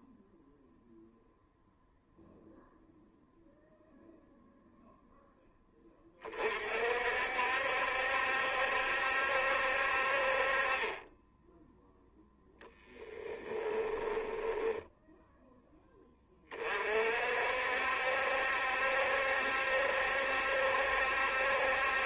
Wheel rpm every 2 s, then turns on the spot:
0, 0, 0, 40, 70, 50, 10, 10, 40, 70, 70.
14-16